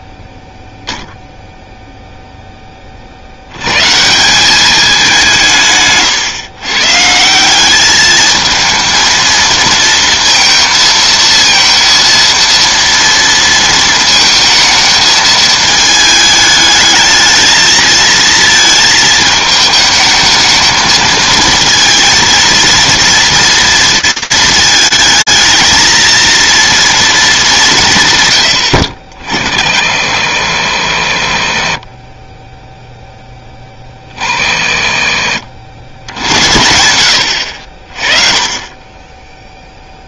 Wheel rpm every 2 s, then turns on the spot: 0, 10, 200, 130, 220, 230, 230, 220, 210, 220, 220, 230, 220, 230, 90, 80, 10, 50, 90, 10.
34-36